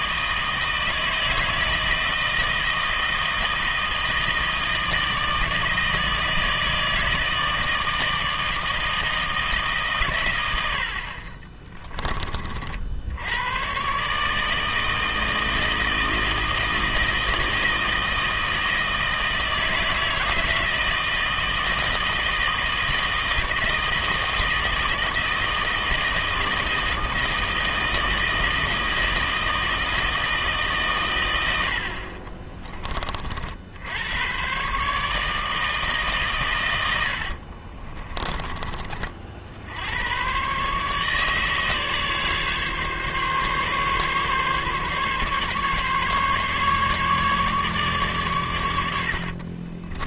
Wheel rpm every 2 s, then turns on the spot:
160, 160, 160, 160, 160, 70, 50, 160, 160, 160, 160, 160, 160, 160, 160, 140, 20, 130, 110, 30, 140, 140, 140, 140, 100.
none